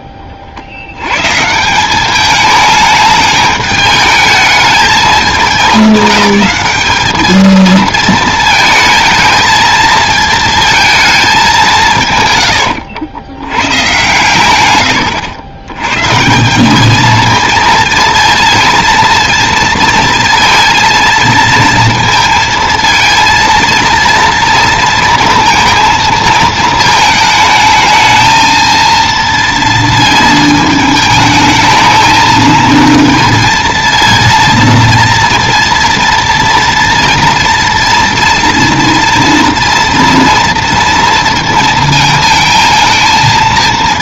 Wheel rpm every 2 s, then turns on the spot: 90, 210, 220, 210, 220, 220, 80, 110, 210, 230, 230, 230, 230, 220, 230, 220, 230, 230, 230, 230, 230, 220.
none